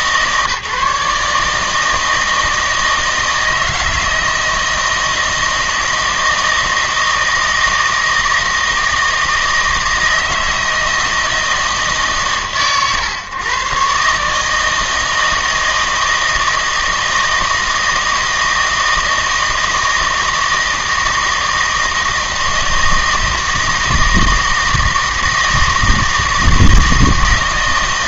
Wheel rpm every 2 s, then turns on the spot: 150, 160, 160, 160, 160, 160, 130, 160, 160, 160, 160, 160, 160, 160.
none